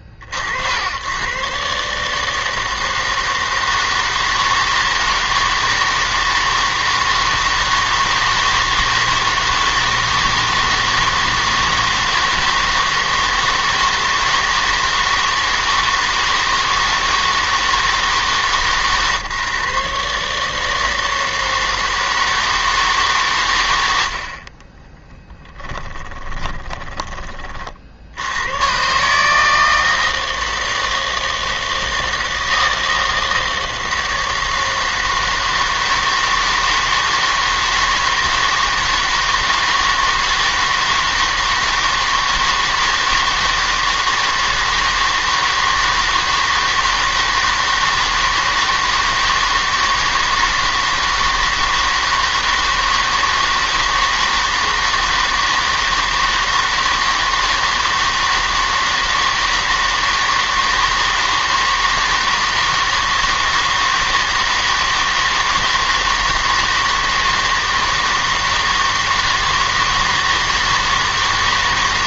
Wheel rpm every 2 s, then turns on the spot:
80, 160, 160, 160, 160, 160, 160, 160, 160, 140, 160, 160, 20, 20, 130, 160, 160, 160, 160, 160, 160, 160, 160, 160, 160, 160, 160, 160, 160, 160, 160, 160, 160, 160, 160, 160.
26-28